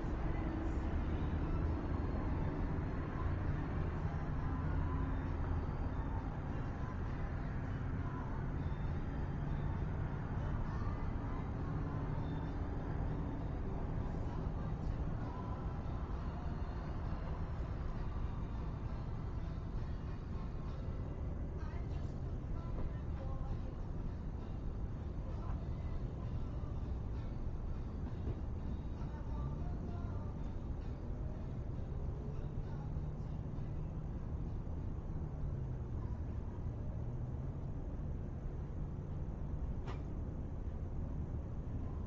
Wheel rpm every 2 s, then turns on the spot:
0, 0, 0, 0, 0, 0, 0, 0, 0, 0, 0, 0, 0, 0, 0, 0, 0, 0, 0, 0, 0.
none